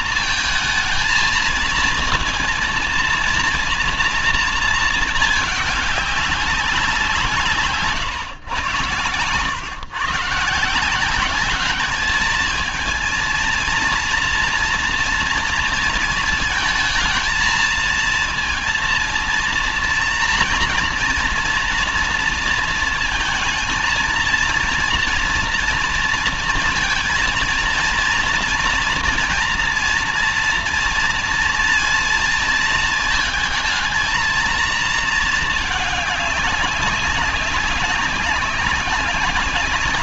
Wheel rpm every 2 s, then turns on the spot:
220, 230, 220, 190, 110, 160, 220, 240, 230, 230, 230, 230, 230, 230, 230, 240, 220, 220, 200, 190.
none